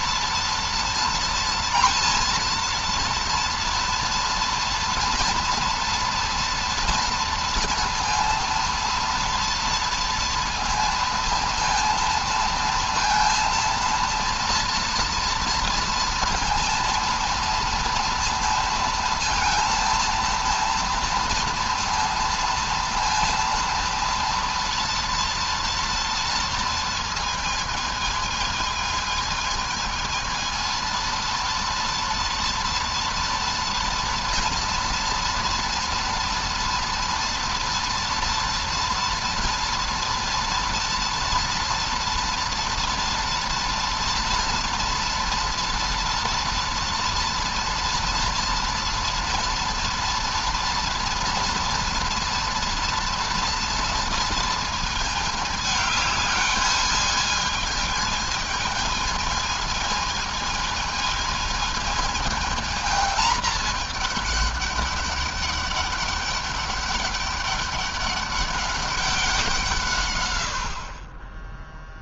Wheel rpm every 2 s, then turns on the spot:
230, 230, 230, 240, 230, 230, 230, 230, 230, 230, 230, 230, 230, 230, 220, 230, 230, 230, 230, 230, 230, 230, 230, 230, 230, 230, 230, 220, 210, 220, 220, 220, 200, 200, 200, 70.
none